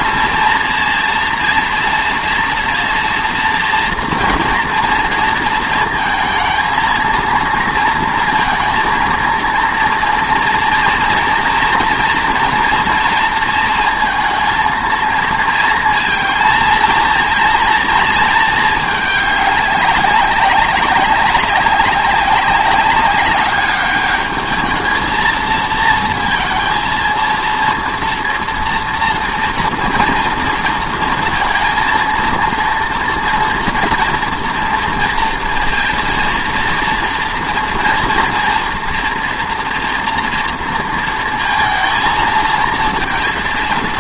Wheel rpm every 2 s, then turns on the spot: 230, 230, 240, 230, 230, 230, 230, 230, 230, 220, 200, 200, 220, 230, 230, 230, 230, 240, 230, 230, 230, 230.
none